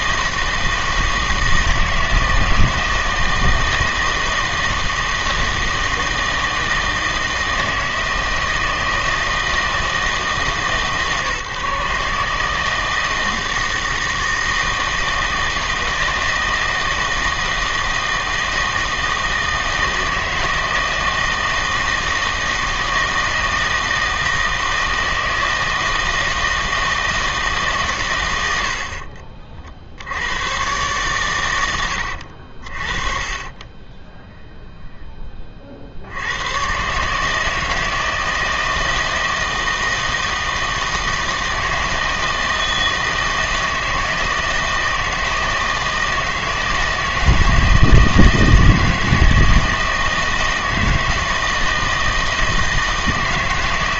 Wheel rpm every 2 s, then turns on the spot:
160, 160, 160, 160, 160, 150, 160, 160, 160, 160, 160, 160, 160, 160, 70, 120, 50, 0, 120, 160, 160, 160, 160, 160, 160, 160, 160.
none